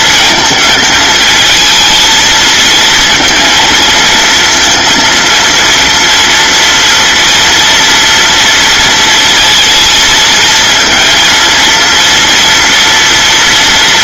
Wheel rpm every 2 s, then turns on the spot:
220, 230, 230, 230, 230, 230, 240.
none